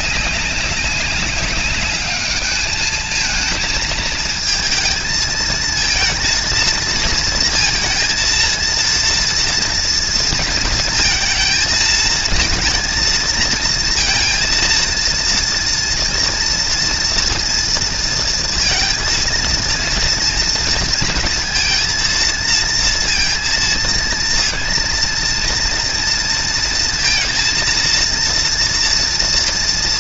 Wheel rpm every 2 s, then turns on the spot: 190, 210, 220, 230, 230, 220, 230, 230, 230, 230, 230, 230, 230, 230, 230.
none